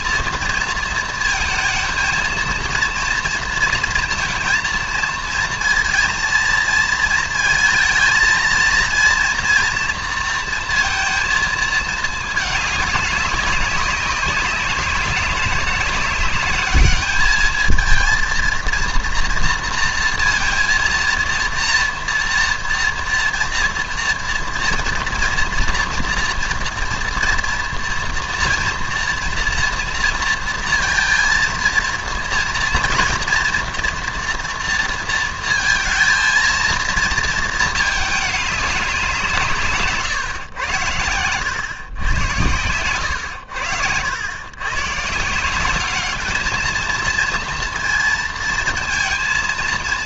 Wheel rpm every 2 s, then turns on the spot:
230, 230, 230, 230, 230, 230, 210, 190, 210, 230, 230, 230, 230, 230, 240, 230, 230, 230, 230, 190, 110, 100, 120, 220, 230.
none